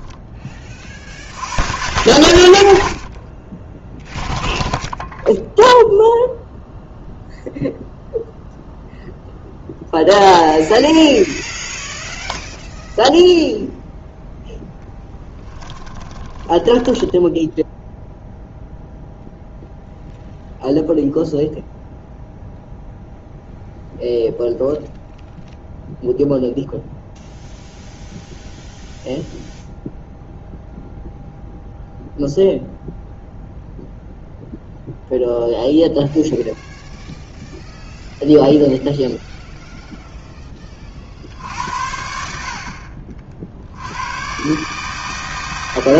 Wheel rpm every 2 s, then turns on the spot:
20, 30, 0, 0, 0, 0, 0, 0, 10, 0, 0, 0, 0, 0, 0, 0, 0, 0, 0, 0, 40, 50, 150.
16-18